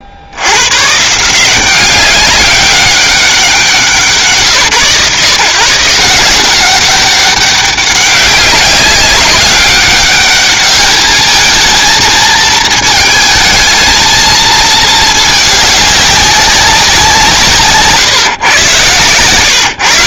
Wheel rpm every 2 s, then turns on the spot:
120, 200, 140, 180, 190, 210, 220, 220, 190, 130.
none